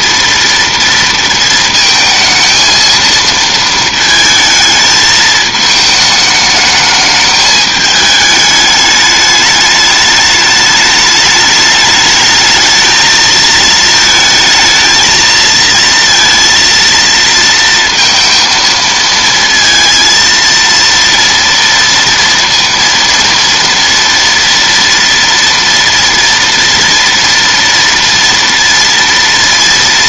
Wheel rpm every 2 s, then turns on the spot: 230, 220, 220, 220, 210, 210, 220, 220, 230, 230, 230, 230, 230, 240, 230.
none